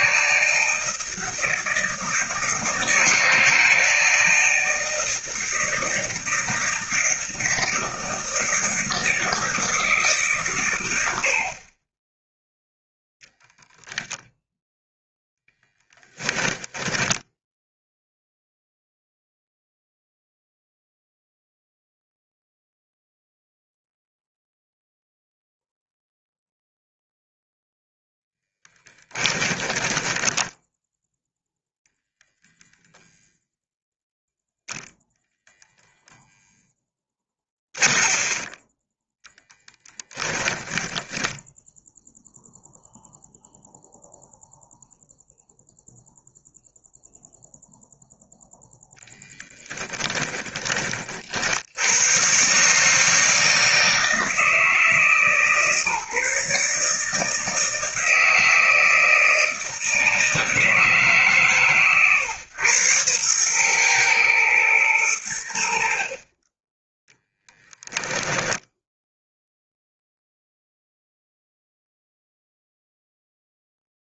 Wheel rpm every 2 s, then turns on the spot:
160, 160, 160, 170, 160, 110, 0, 0, 10, 0, 0, 0, 0, 0, 20, 10, 0, 0, 10, 10, 10, 0, 0, 0, 10, 40, 150, 160, 150, 160, 150, 110, 110, 20, 10, 0, 0.
16-18 28-32 36-40 68-70